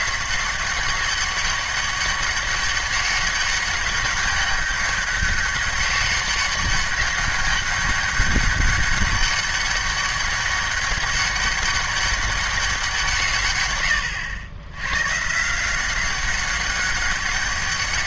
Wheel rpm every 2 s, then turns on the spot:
190, 200, 200, 190, 200, 200, 190, 100, 190.
none